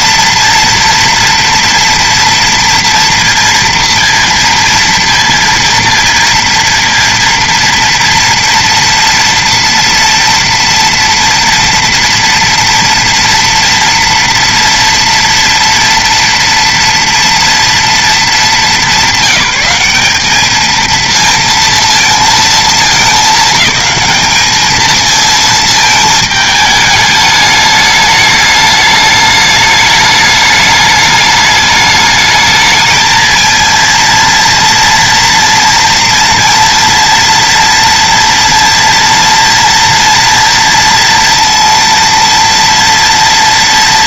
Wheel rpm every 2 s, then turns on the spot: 230, 230, 230, 230, 230, 230, 230, 230, 230, 210, 210, 220, 210, 220, 210, 210, 220, 230, 230, 230, 230, 230.
none